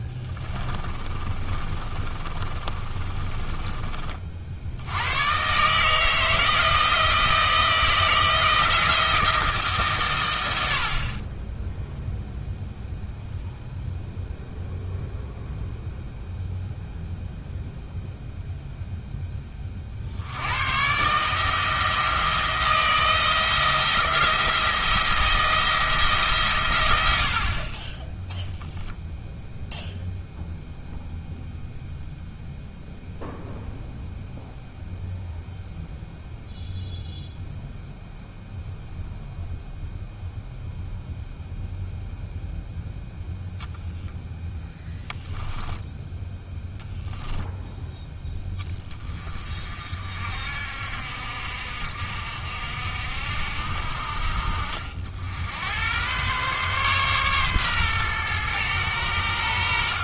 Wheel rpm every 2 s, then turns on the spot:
20, 30, 80, 160, 170, 70, 0, 0, 0, 0, 110, 160, 170, 110, 10, 0, 0, 0, 0, 0, 0, 0, 0, 0, 20, 60, 60, 60, 130, 110.
0-4